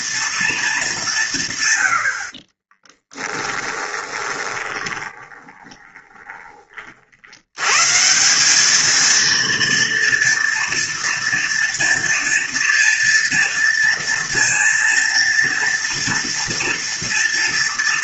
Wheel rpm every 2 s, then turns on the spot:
220, 30, 20, 40, 210, 230, 230, 230, 230.
2-6